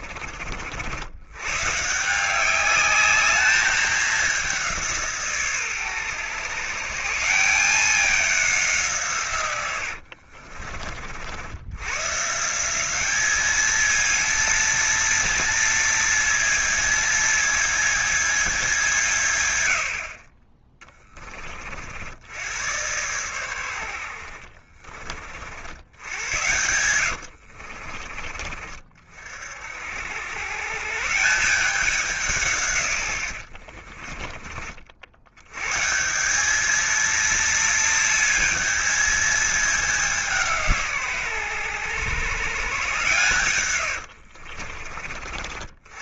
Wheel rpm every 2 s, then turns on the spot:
70, 200, 170, 150, 170, 60, 180, 230, 230, 180, 20, 110, 50, 90, 40, 130, 130, 60, 210, 220, 150, 120, 40.
24-28